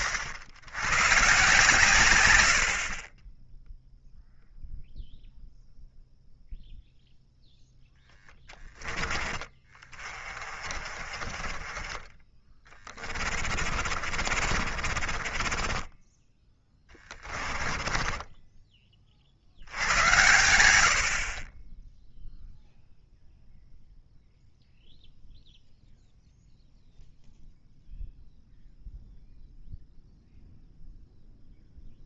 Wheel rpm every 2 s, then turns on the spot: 120, 40, 0, 0, 20, 40, 20, 40, 20, 20, 70, 0, 0, 0, 0, 0.
12-18